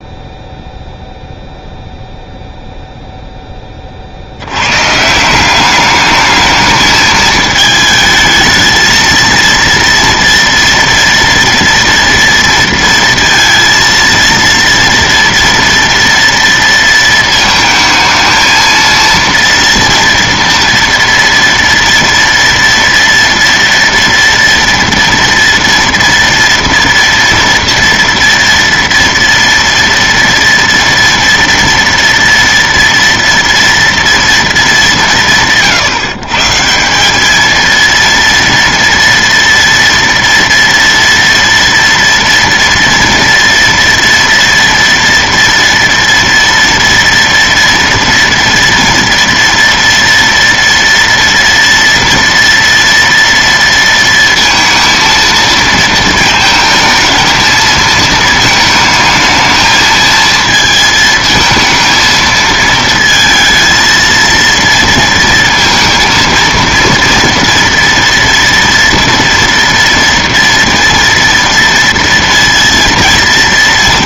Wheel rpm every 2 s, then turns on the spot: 0, 0, 90, 210, 220, 230, 230, 230, 230, 220, 230, 230, 230, 230, 230, 230, 230, 220, 150, 230, 230, 230, 230, 230, 230, 230, 230, 230, 220, 220, 230, 230, 230, 230, 230, 230, 230.
none